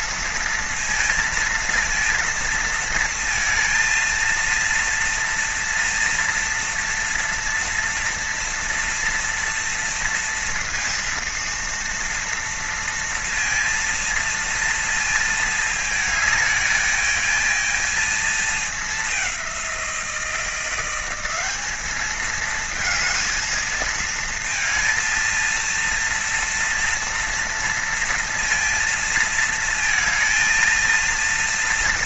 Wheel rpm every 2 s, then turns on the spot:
230, 230, 230, 230, 230, 230, 230, 230, 220, 220, 180, 220, 230, 230, 230, 230.
none